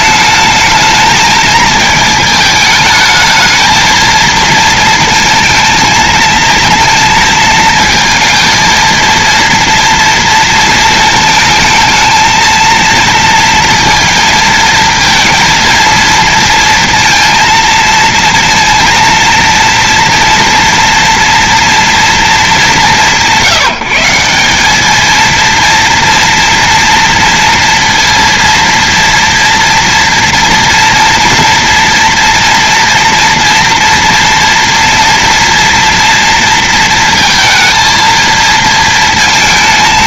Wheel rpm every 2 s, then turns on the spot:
220, 220, 230, 230, 230, 230, 230, 230, 230, 230, 230, 170, 200, 230, 230, 230, 230, 230, 230, 230.
none